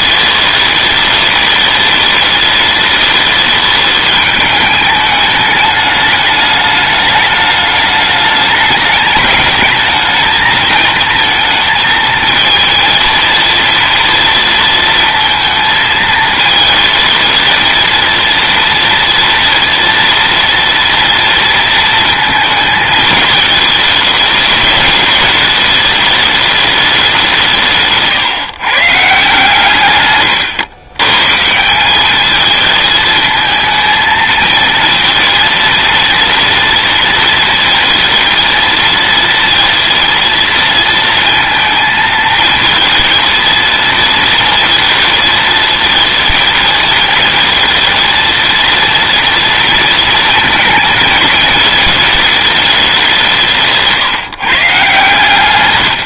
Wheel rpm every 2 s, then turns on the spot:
210, 210, 210, 210, 210, 220, 230, 230, 220, 230, 230, 220, 210, 200, 150, 120, 220, 230, 230, 230, 230, 220, 230, 230, 230, 220, 200, 150.
none